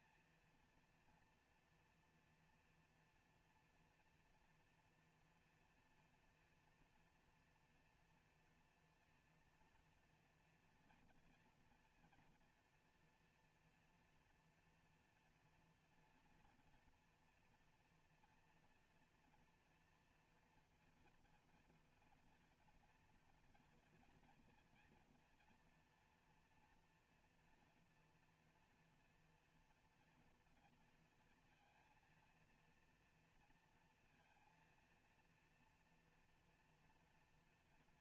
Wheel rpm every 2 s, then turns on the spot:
230, 230, 240, 240, 230, 230, 230, 230, 230, 240, 240, 240, 230, 230, 230, 230, 230, 230, 230.
none